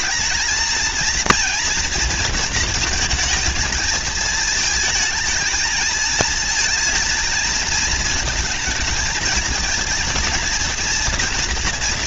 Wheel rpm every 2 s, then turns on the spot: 220, 230, 220, 230, 220, 230.
none